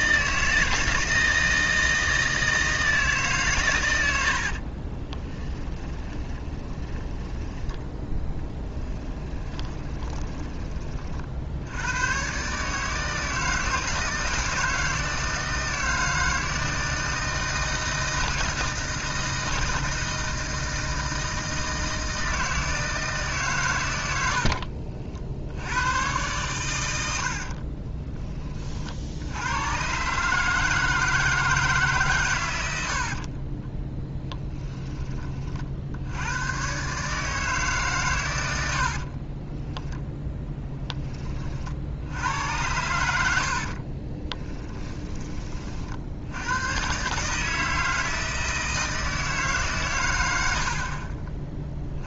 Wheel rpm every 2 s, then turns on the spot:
160, 160, 60, 10, 10, 20, 140, 160, 160, 160, 160, 160, 60, 110, 40, 160, 80, 10, 110, 80, 10, 90, 20, 110, 160, 60.
4-8 24-26 38-40 44-46